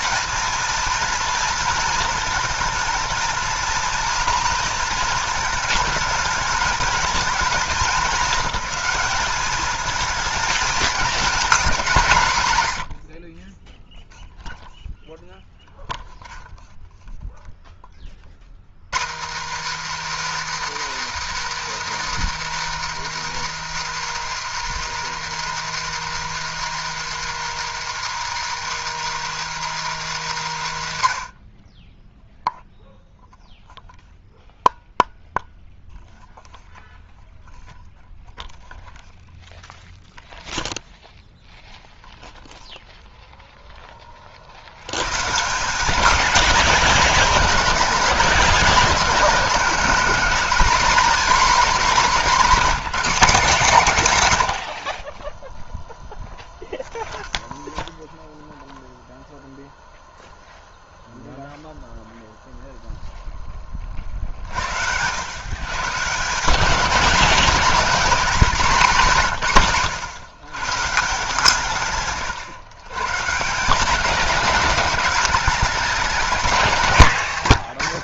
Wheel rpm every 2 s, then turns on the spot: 220, 220, 230, 220, 210, 220, 120, 0, 0, 140, 340, 340, 340, 340, 340, 240, 0, 0, 0, 0, 0, 0, 80, 210, 210, 240, 230, 90, 0, 0, 0, 0, 60, 190, 210, 140, 120, 220, 220.
none